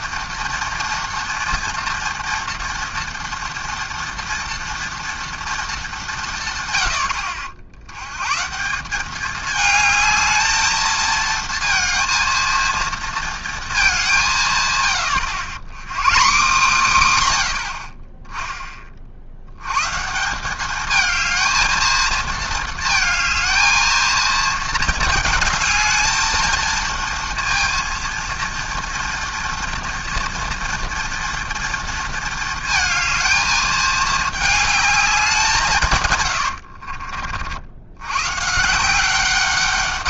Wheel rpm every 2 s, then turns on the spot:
230, 230, 230, 120, 170, 220, 230, 130, 190, 20, 200, 220, 220, 220, 230, 230, 220, 210, 80, 150.
36-38